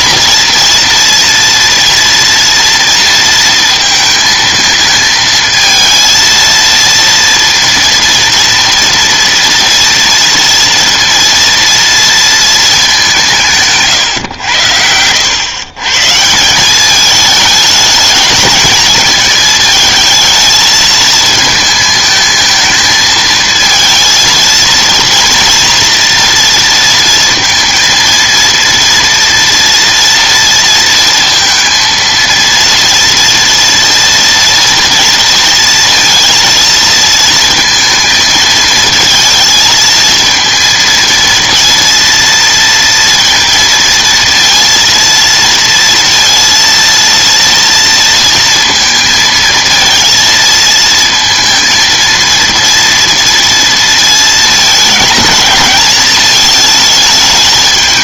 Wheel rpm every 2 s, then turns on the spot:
230, 230, 220, 230, 230, 230, 220, 90, 180, 220, 220, 220, 230, 230, 230, 230, 230, 230, 230, 220, 230, 230, 230, 230, 230, 220, 230, 220, 220.
none